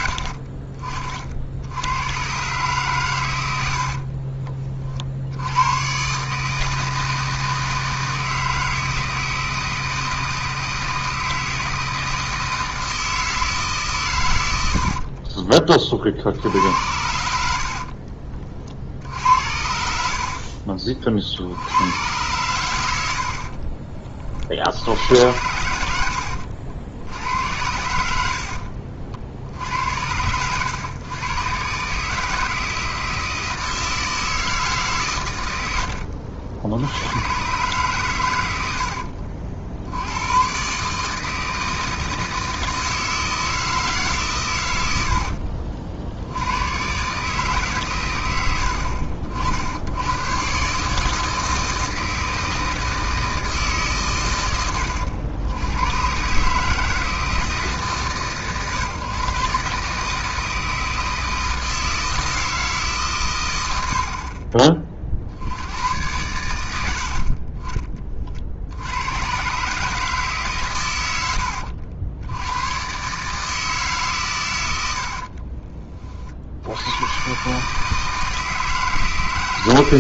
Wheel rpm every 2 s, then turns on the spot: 50, 130, 30, 150, 160, 160, 160, 80, 70, 50, 50, 100, 60, 70, 60, 110, 160, 150, 80, 80, 130, 160, 110, 100, 80, 140, 160, 100, 150, 130, 160, 160, 30, 100, 60, 140, 110, 100, 70, 160.
20-22 28-30 38-40 64-66